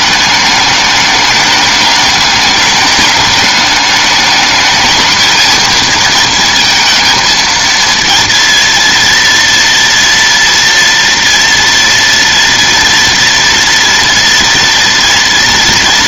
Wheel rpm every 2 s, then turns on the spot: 210, 210, 220, 230, 230, 230, 240, 230.
none